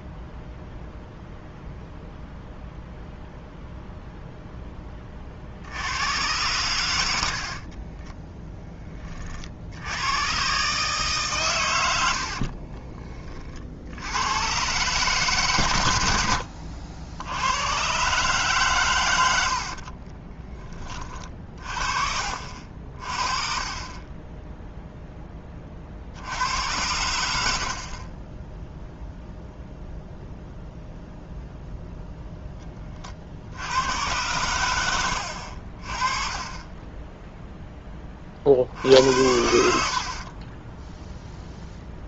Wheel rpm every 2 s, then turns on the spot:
0, 0, 20, 90, 20, 140, 40, 140, 70, 100, 20, 40, 0, 90, 0, 0, 30, 90, 20, 60, 10.
none